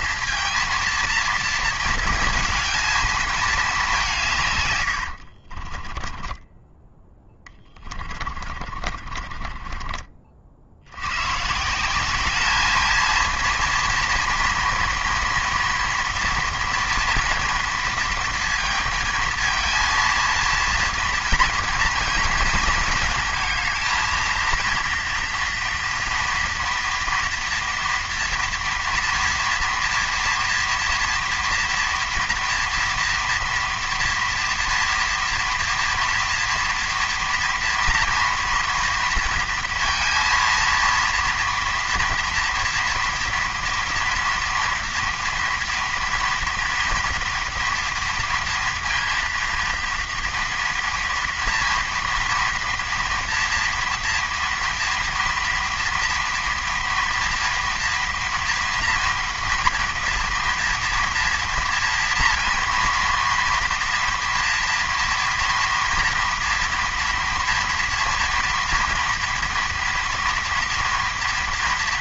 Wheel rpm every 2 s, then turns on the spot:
230, 160, 20, 40, 50, 210, 230, 230, 230, 230, 230, 230, 230, 230, 230, 230, 230, 240, 230, 230, 230, 230, 230, 230, 240, 230, 230, 230, 230, 230, 230, 230, 230, 240, 230, 230.
4-8